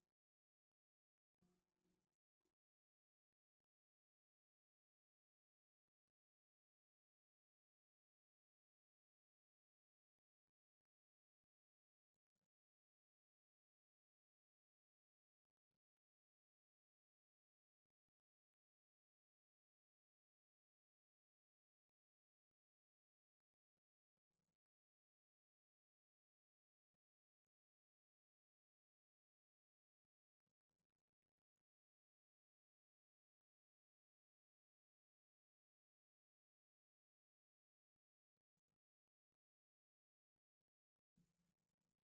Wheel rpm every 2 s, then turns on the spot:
0, 0, 0, 0, 0, 0, 0, 0, 0, 0, 0, 0, 0, 0, 0, 0, 0, 0, 0, 0, 0.
none